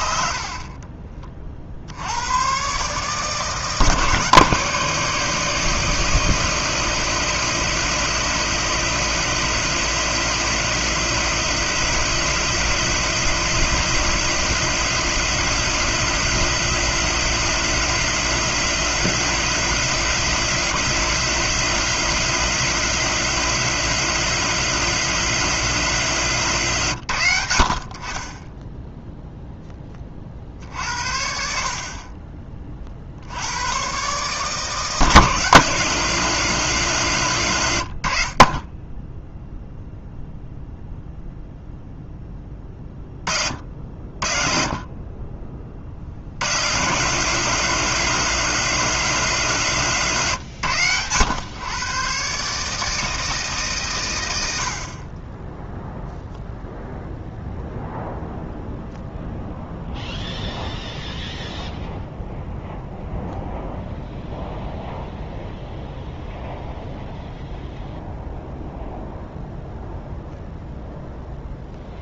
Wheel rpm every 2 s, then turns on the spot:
50, 120, 160, 160, 170, 170, 170, 170, 170, 170, 170, 170, 170, 140, 10, 50, 40, 160, 160, 20, 0, 20, 40, 120, 170, 120, 140, 70, 0, 0, 0, 0, 0, 0, 0, 0.
0-2